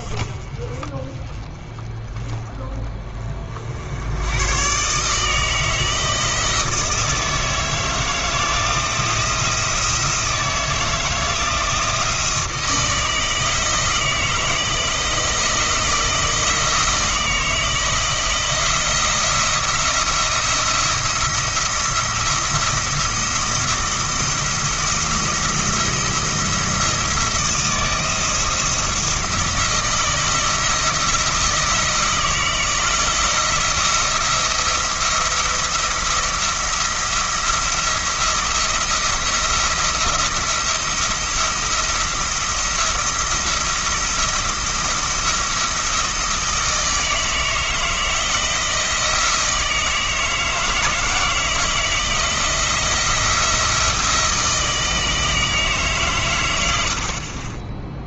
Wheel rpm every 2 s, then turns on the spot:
30, 20, 120, 160, 170, 170, 160, 170, 160, 170, 170, 170, 170, 170, 160, 170, 160, 170, 170, 170, 170, 170, 170, 160, 170, 160, 170, 160, 100.
none